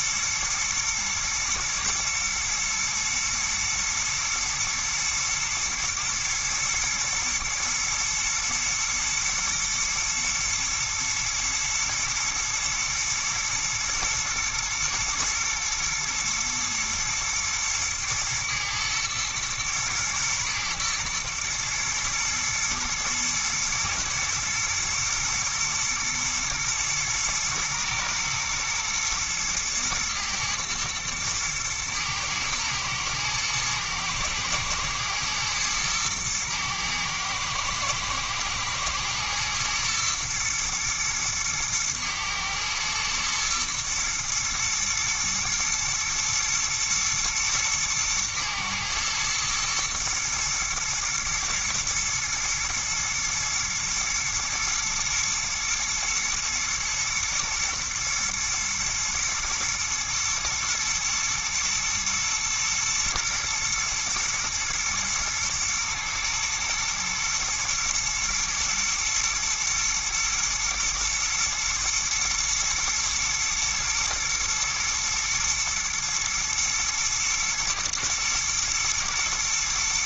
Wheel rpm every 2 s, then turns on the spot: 110, 120, 110, 110, 110, 110, 110, 120, 120, 110, 110, 110, 110, 110, 110, 110, 110, 120, 110, 110, 120, 110, 120, 110, 110, 120, 120, 120, 120, 110, 110, 120, 110, 110, 110, 110, 110, 110, 120, 120.
none